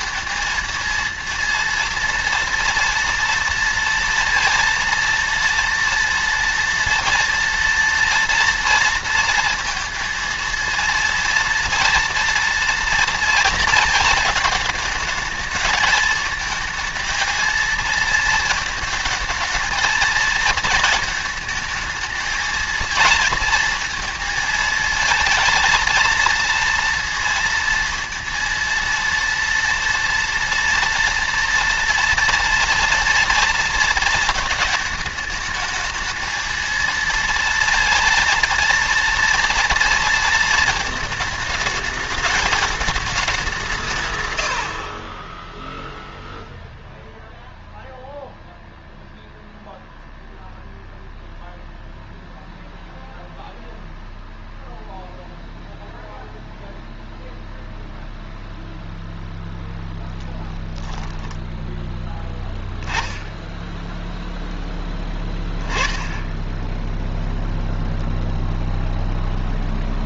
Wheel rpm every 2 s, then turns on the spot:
230, 230, 230, 230, 230, 230, 230, 220, 220, 220, 230, 220, 220, 230, 230, 230, 230, 210, 230, 230, 220, 210, 70, 0, 0, 0, 0, 0, 0, 0, 0, 10, 10, 10, 0.
44-46